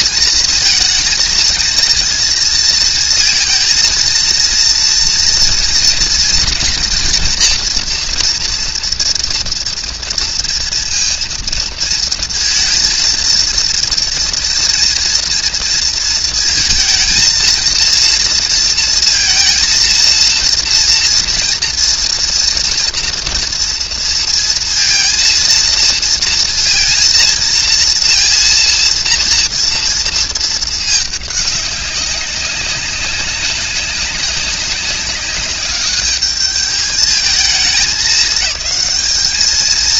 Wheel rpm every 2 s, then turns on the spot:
230, 230, 230, 230, 230, 230, 220, 230, 220, 230, 230, 230, 230, 230, 230, 210, 190, 200, 210, 210.
none